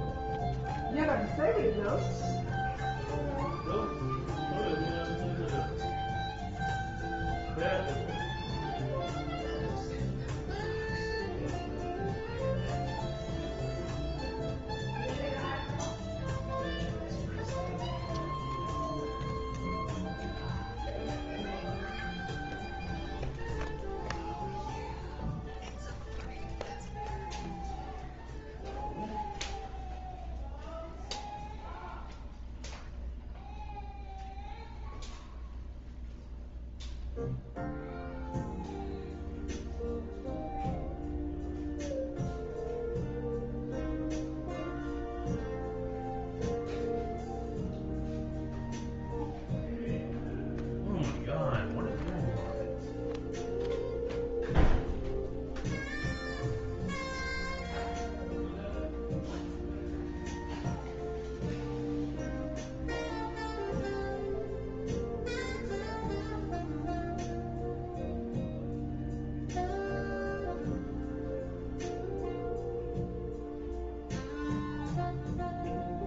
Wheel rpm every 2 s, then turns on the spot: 0, 0, 0, 0, 0, 0, 0, 0, 0, 0, 0, 0, 0, 0, 0, 0, 0, 0, 0, 0, 0, 0, 0, 0, 0, 0, 0, 0, 0, 0, 0, 0, 0, 0, 0, 0, 0, 0.
none